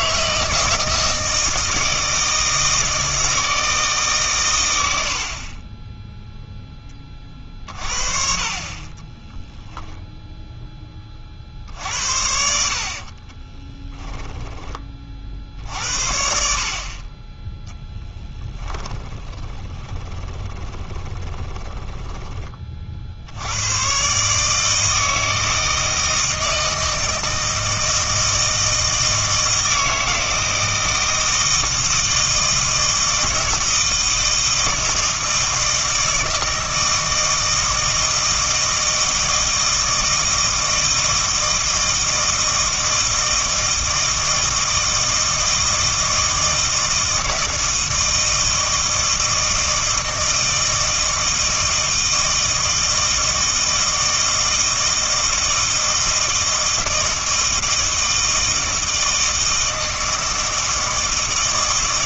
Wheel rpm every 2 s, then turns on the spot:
160, 160, 110, 0, 30, 10, 70, 20, 60, 20, 20, 20, 150, 160, 160, 160, 160, 160, 160, 160, 160, 160, 160, 160, 160, 160, 160, 160, 160, 160, 160.
18-22